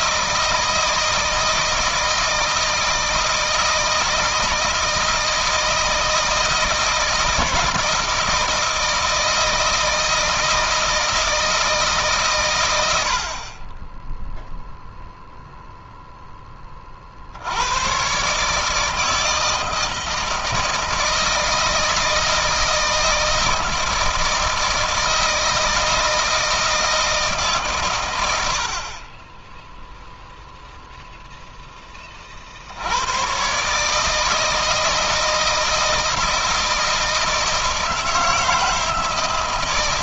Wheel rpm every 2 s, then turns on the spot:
160, 160, 160, 160, 160, 160, 100, 0, 40, 150, 160, 160, 160, 160, 40, 0, 80, 160, 160, 160.
none